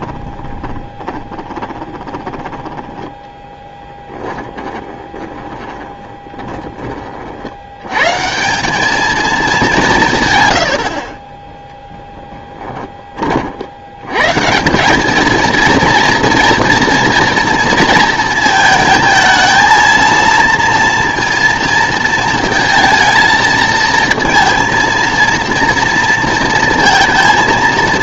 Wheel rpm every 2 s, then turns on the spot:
20, 10, 10, 20, 190, 90, 20, 170, 230, 220, 230, 230, 230, 230.
0-2 4-6 12-14